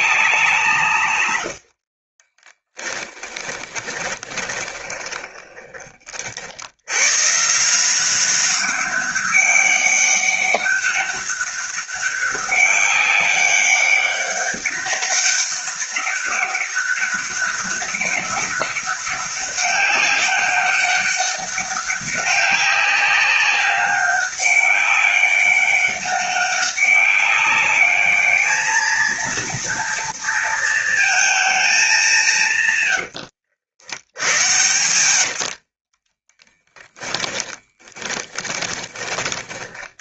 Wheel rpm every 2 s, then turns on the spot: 130, 10, 20, 120, 200, 200, 200, 200, 200, 200, 200, 200, 200, 200, 220, 230, 100, 90, 20, 20.
2-6 32-40